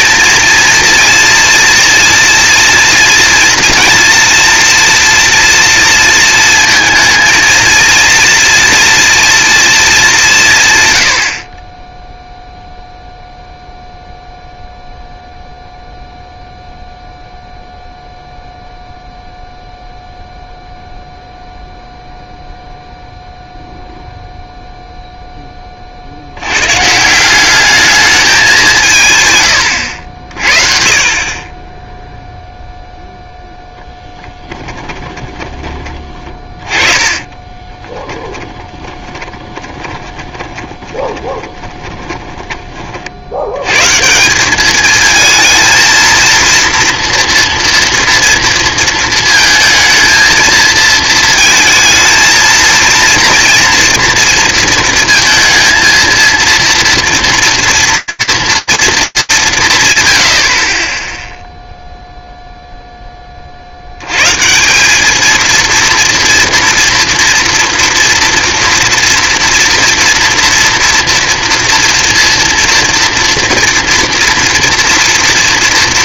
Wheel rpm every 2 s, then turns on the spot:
230, 240, 240, 230, 240, 140, 0, 0, 0, 0, 0, 0, 0, 120, 190, 50, 0, 20, 20, 20, 20, 40, 210, 230, 230, 220, 230, 230, 230, 220, 30, 10, 200, 230, 230, 240, 230, 230.
34-42